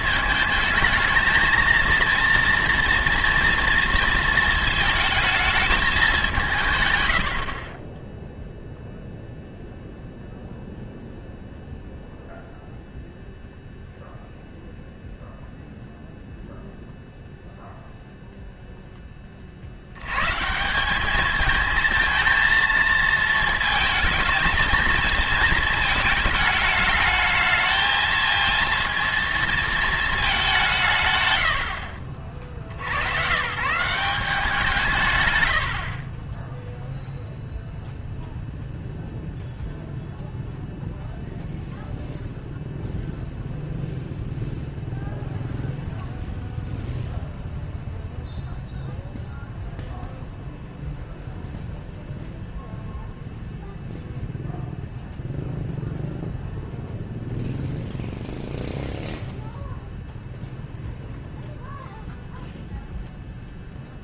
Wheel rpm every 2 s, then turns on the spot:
220, 230, 230, 160, 0, 0, 0, 0, 0, 0, 160, 220, 220, 220, 230, 180, 50, 170, 0, 0, 0, 0, 0, 0, 0, 0, 0, 0, 0, 0, 0, 0.
none